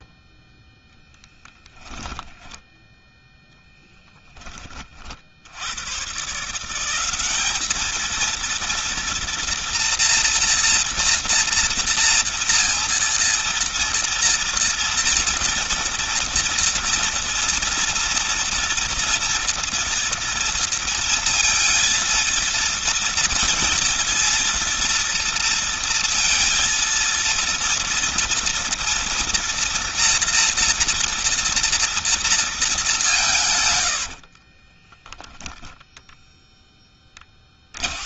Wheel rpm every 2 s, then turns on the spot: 0, 10, 30, 170, 230, 230, 230, 230, 230, 230, 230, 230, 230, 230, 230, 230, 220, 30, 10.
34-38